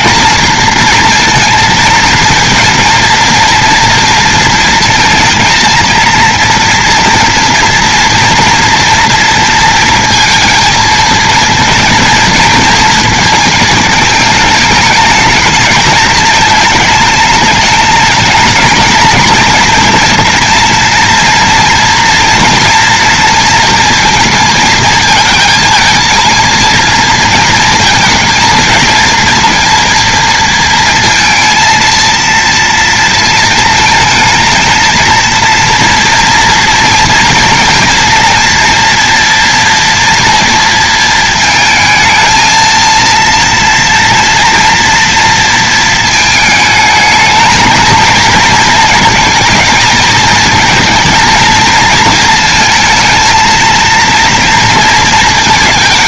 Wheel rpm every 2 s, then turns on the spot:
230, 230, 230, 230, 230, 230, 220, 220, 210, 220, 230, 230, 230, 230, 230, 230, 230, 220, 230, 230, 230, 230, 230, 220, 230, 220, 230, 230.
none